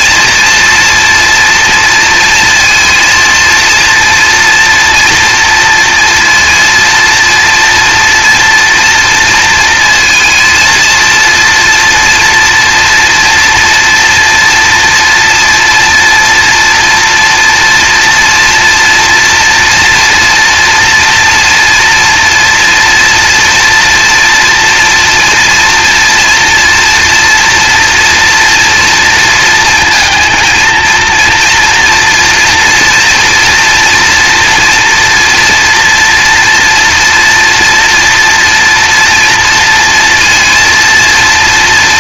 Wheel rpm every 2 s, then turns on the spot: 230, 230, 230, 240, 230, 230, 240, 230, 230, 240, 230, 230, 230, 240, 230, 220, 230, 230, 230, 240, 230.
none